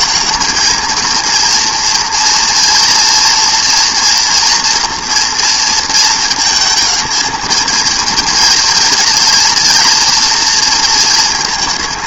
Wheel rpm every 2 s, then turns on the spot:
220, 230, 230, 220, 230, 230.
none